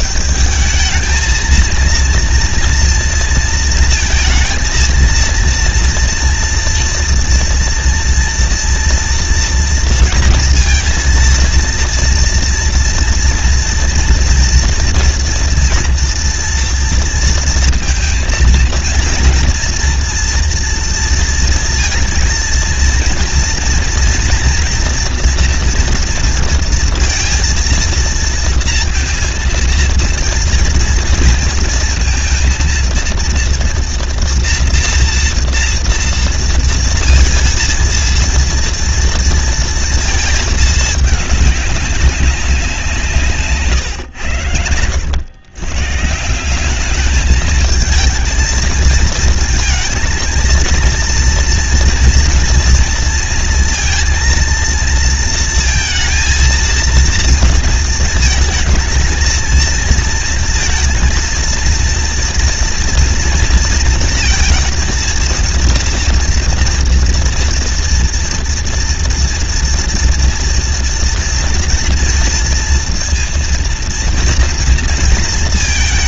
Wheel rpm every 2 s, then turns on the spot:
210, 230, 230, 230, 230, 230, 230, 230, 230, 230, 230, 230, 230, 230, 230, 230, 230, 230, 230, 230, 220, 190, 100, 180, 220, 230, 240, 230, 230, 220, 230, 230, 230, 230, 230, 230, 230, 230.
none